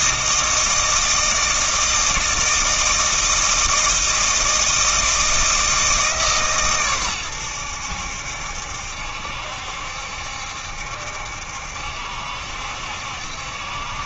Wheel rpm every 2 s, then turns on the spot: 160, 160, 160, 120, 70, 70, 70.
none